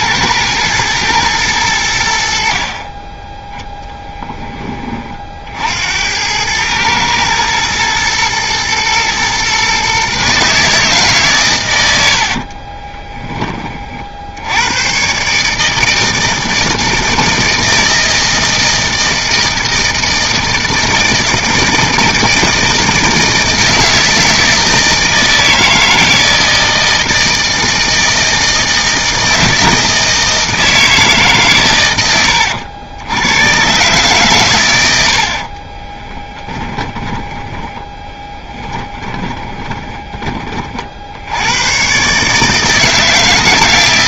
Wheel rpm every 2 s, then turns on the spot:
110, 50, 20, 110, 120, 150, 40, 100, 160, 160, 160, 160, 160, 160, 160, 160, 90, 110, 10, 10, 30, 160.
12-14 36-40